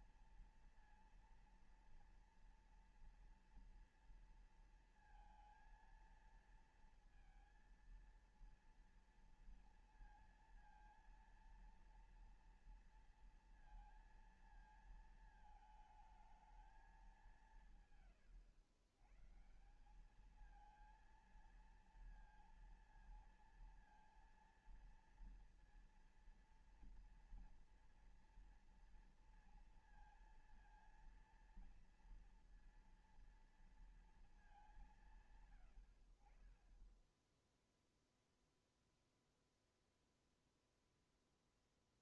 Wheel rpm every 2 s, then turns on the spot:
230, 230, 230, 230, 230, 230, 230, 230, 220, 130, 200, 230, 230, 230, 230, 230, 230, 220, 60, 0, 0.
none